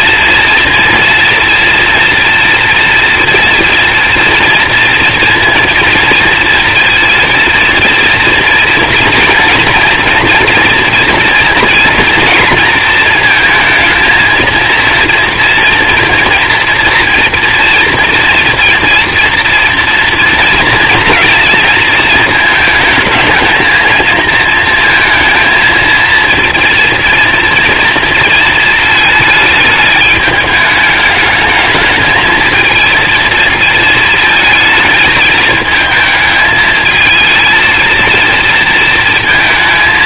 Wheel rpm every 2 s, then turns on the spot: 230, 230, 230, 230, 230, 230, 230, 230, 230, 230, 230, 220, 220, 230, 220, 220, 230, 220, 220, 230.
none